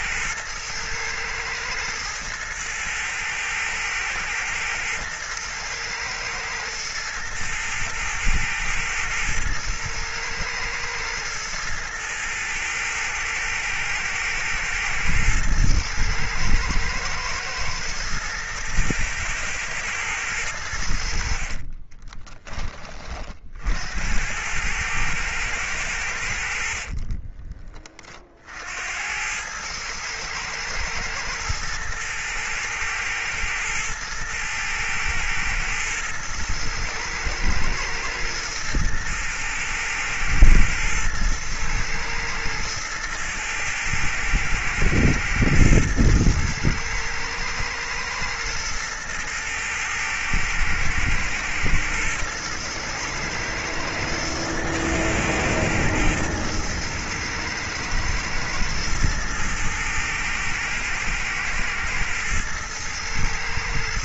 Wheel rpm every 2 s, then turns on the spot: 110, 110, 110, 110, 110, 110, 120, 120, 110, 110, 80, 30, 110, 40, 80, 110, 110, 110, 110, 110, 110, 110, 110, 110, 110, 110, 110, 110, 110, 110, 110, 110.
26-28